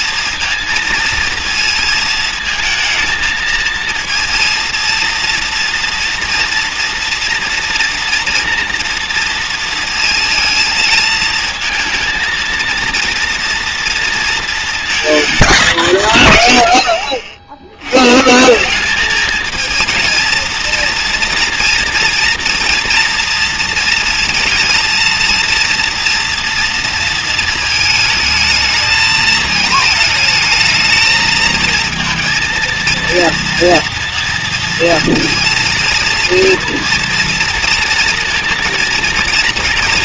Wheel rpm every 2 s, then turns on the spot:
230, 220, 230, 230, 230, 230, 230, 230, 120, 190, 230, 230, 230, 230, 220, 220, 230, 230, 230, 230.
none